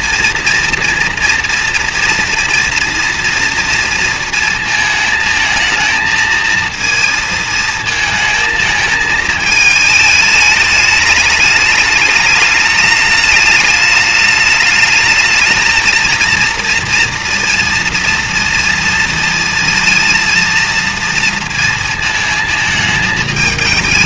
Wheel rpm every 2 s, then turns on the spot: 230, 230, 220, 220, 220, 210, 210, 220, 230, 220, 230, 210.
none